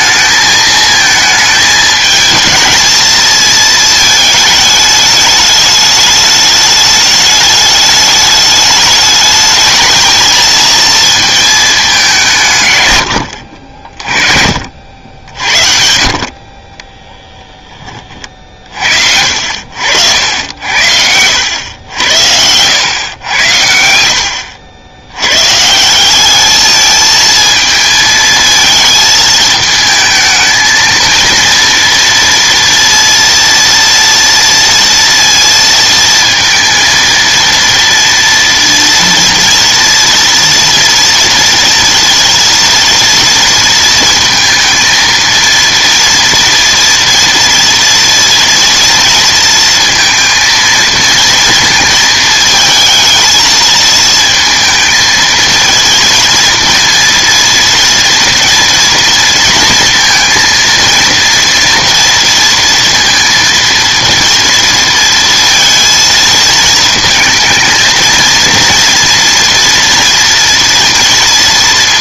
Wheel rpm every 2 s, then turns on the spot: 220, 220, 220, 210, 210, 220, 140, 60, 30, 50, 70, 90, 80, 210, 220, 220, 230, 230, 230, 230, 230, 230, 230, 240, 230, 230, 220, 220, 230, 230, 230, 230, 230, 220, 230, 230.
none